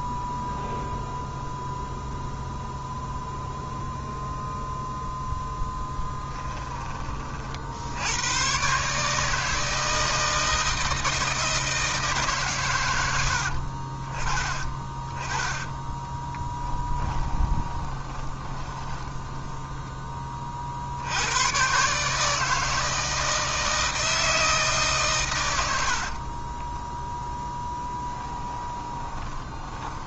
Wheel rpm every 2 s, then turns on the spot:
0, 0, 0, 20, 150, 160, 90, 20, 20, 20, 70, 160, 130, 10, 20.
14-20 28-30